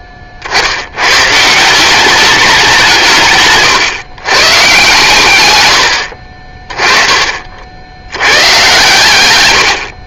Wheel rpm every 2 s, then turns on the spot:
40, 190, 130, 40, 120.
none